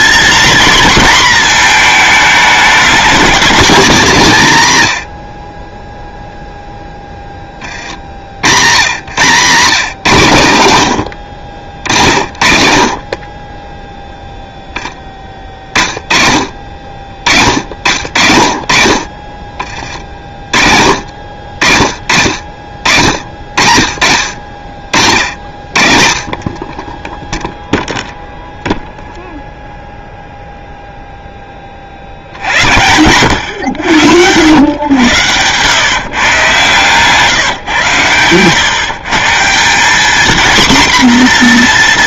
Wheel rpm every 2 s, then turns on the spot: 240, 220, 140, 0, 110, 110, 50, 10, 40, 40, 50, 60, 60, 30, 0, 0, 90, 110, 140, 120, 250.
36-38